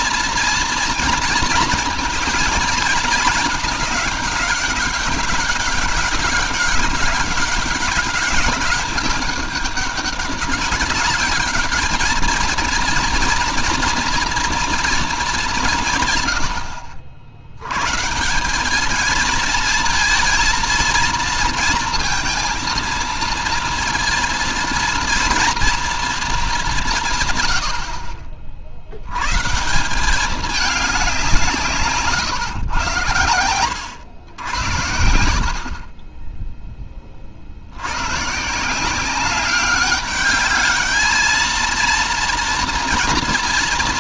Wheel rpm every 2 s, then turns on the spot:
230, 220, 200, 200, 200, 200, 230, 230, 80, 190, 230, 230, 230, 180, 50, 200, 100, 90, 10, 160, 210, 230.
none